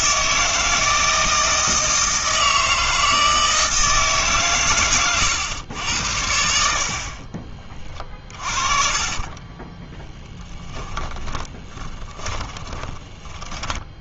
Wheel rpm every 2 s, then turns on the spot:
160, 160, 130, 60, 30, 10, 20.
8-14